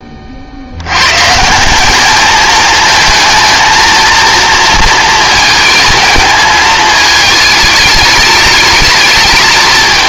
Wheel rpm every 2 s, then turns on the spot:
130, 220, 230, 220, 220.
none